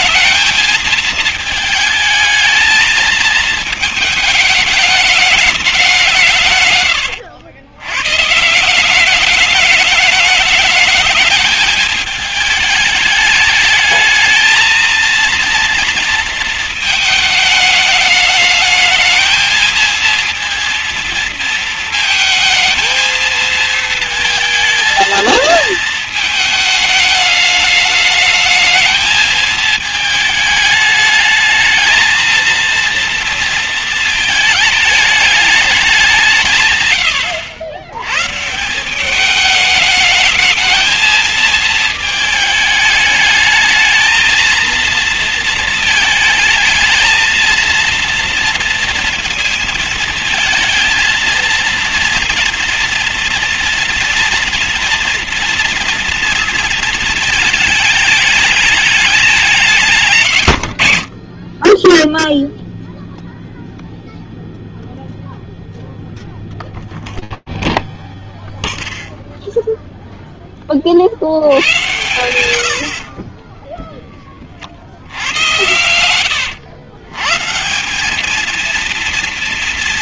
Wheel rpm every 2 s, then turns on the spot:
220, 220, 220, 150, 140, 210, 210, 220, 230, 220, 230, 220, 230, 220, 220, 220, 230, 220, 180, 140, 210, 220, 220, 220, 230, 230, 230, 240, 230, 210, 120, 0, 0, 0, 0, 10, 100, 50, 130, 230.
none